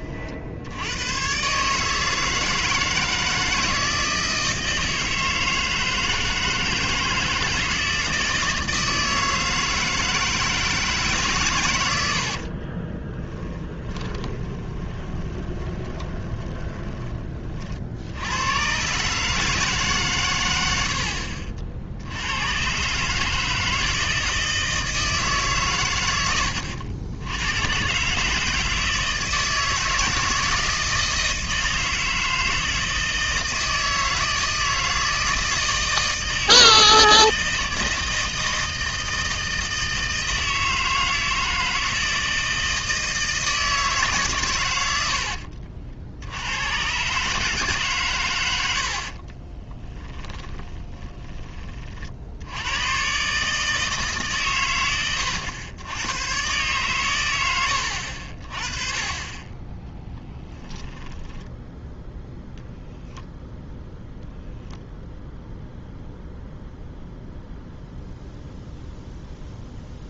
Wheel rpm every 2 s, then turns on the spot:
100, 160, 160, 160, 160, 150, 30, 20, 20, 130, 80, 140, 160, 90, 160, 160, 160, 160, 160, 160, 160, 160, 90, 120, 70, 20, 110, 110, 120, 30, 0, 0, 0, 0, 0.
12-18 48-52